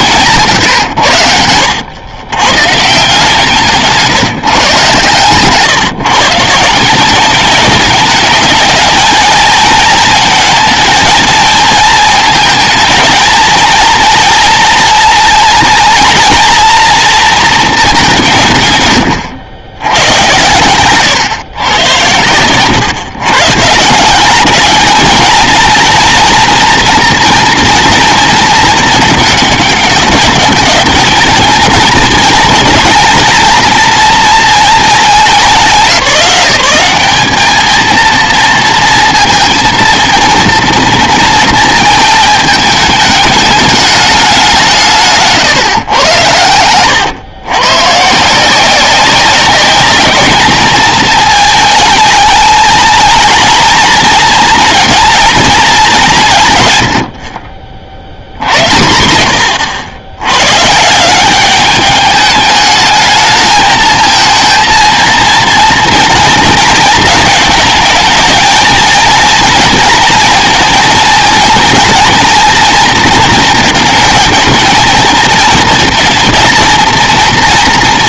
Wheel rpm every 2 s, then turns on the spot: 150, 130, 150, 160, 220, 220, 220, 230, 230, 140, 120, 110, 190, 230, 220, 200, 220, 230, 190, 230, 230, 220, 190, 100, 170, 220, 220, 230, 150, 80, 110, 210, 230, 230, 220, 230, 240, 230, 230.
46-48